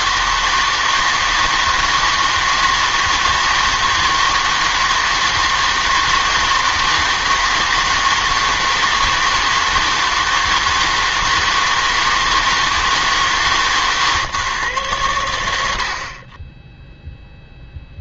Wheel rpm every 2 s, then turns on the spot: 160, 160, 160, 160, 160, 160, 160, 130, 10.
none